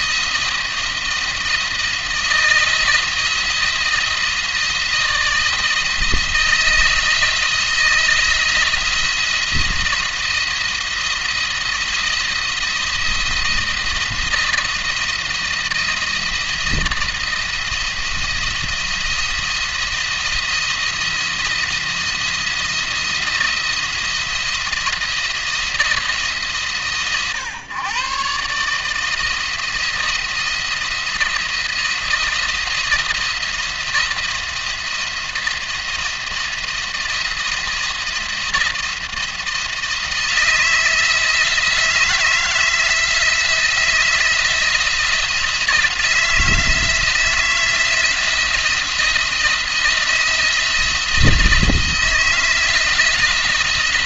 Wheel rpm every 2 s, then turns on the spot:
170, 160, 160, 170, 170, 170, 170, 170, 170, 170, 170, 170, 170, 140, 150, 170, 170, 170, 170, 170, 170, 160, 170, 160, 170, 170, 170.
none